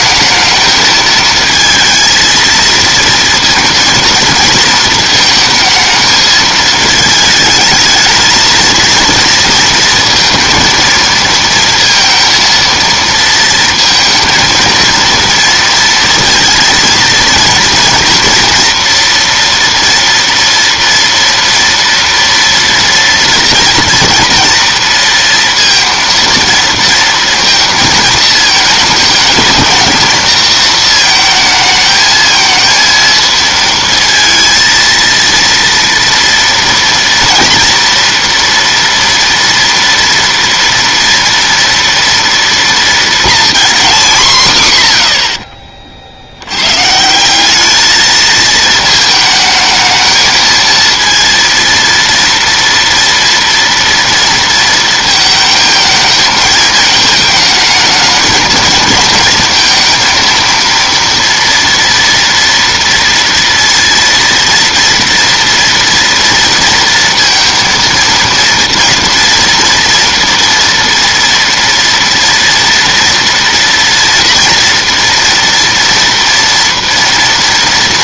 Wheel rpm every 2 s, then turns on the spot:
220, 220, 220, 220, 230, 230, 230, 230, 230, 230, 230, 240, 230, 230, 220, 230, 230, 230, 230, 230, 230, 230, 120, 120, 220, 220, 230, 230, 220, 220, 230, 230, 230, 230, 230, 230, 230, 230, 230.
none